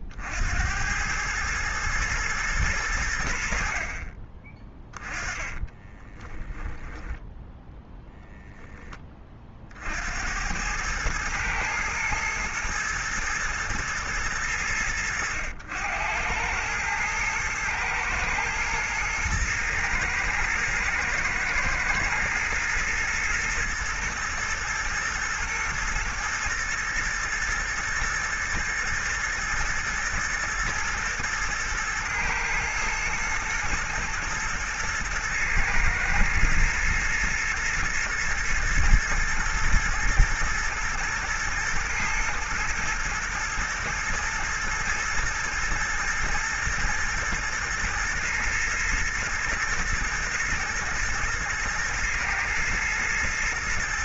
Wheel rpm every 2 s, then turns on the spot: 90, 100, 20, 10, 20, 110, 120, 100, 110, 110, 110, 120, 120, 120, 110, 110, 110, 110, 120, 120, 110, 110, 120, 110, 110, 110, 120.
4-8